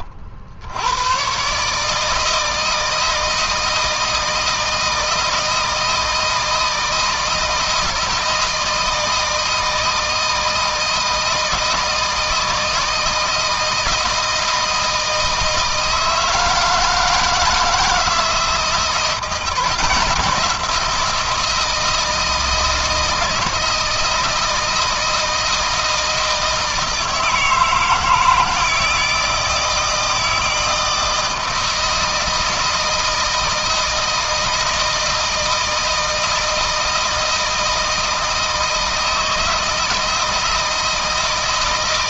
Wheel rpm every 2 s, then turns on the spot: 100, 160, 160, 160, 160, 160, 160, 160, 160, 170, 170, 160, 160, 160, 160, 160, 160, 160, 160, 160, 160.
none